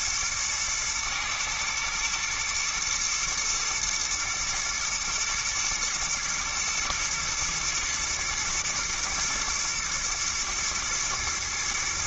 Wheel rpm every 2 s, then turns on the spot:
110, 110, 110, 120, 120, 110.
none